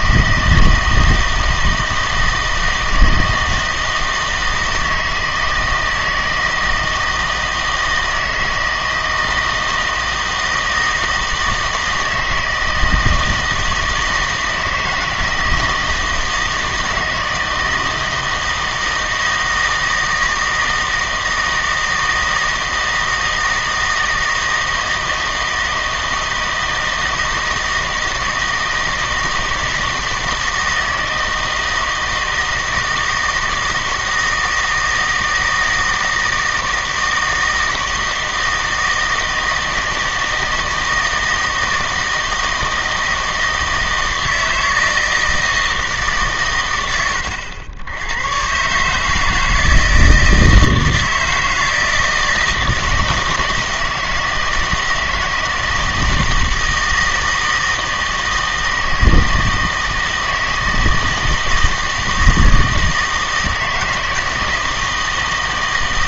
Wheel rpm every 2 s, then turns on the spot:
160, 160, 160, 160, 160, 160, 160, 160, 160, 160, 160, 160, 160, 160, 160, 160, 160, 160, 160, 160, 160, 160, 160, 110, 130, 160, 160, 160, 160, 160, 160, 160, 160.
none